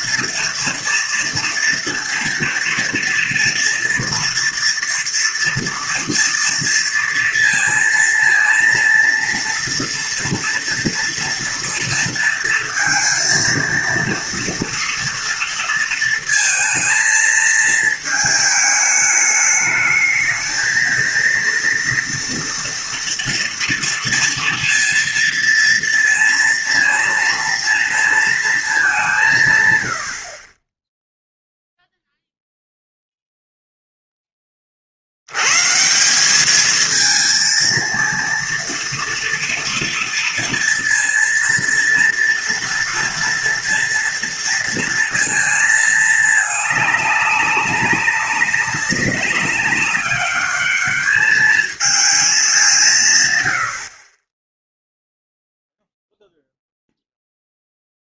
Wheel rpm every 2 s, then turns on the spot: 230, 230, 230, 230, 230, 230, 230, 230, 220, 210, 220, 230, 230, 230, 220, 30, 0, 30, 210, 230, 230, 230, 230, 210, 200, 200, 190, 10, 0.
none